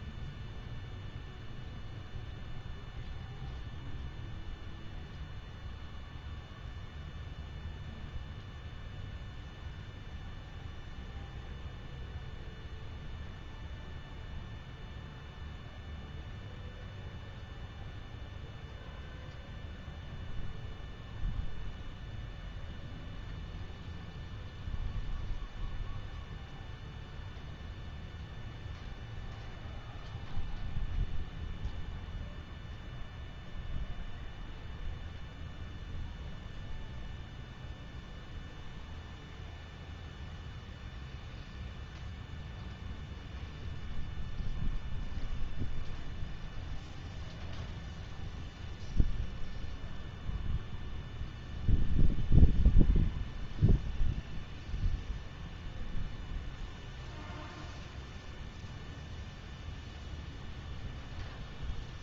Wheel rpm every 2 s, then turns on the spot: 0, 0, 0, 0, 0, 0, 0, 0, 0, 0, 0, 0, 0, 0, 0, 0, 0, 0, 0, 0, 0, 0, 0, 0, 0, 0, 0, 0, 0, 0, 0.
none